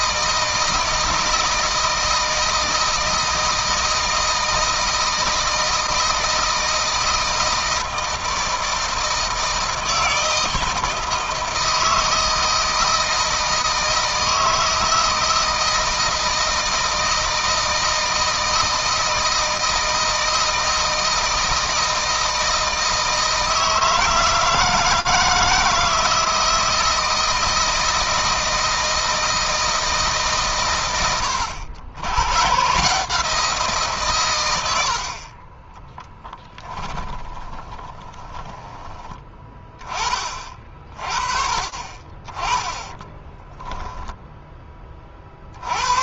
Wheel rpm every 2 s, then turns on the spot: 160, 160, 160, 160, 160, 160, 160, 160, 160, 160, 160, 160, 160, 160, 160, 110, 160, 80, 10, 10, 30, 10, 30.
36-38 42-44